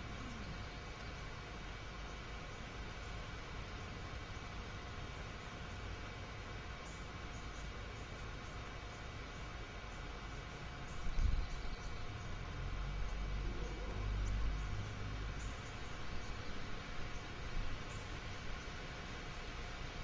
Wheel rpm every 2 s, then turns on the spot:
0, 0, 0, 0, 0, 0, 0, 0, 0, 0.
none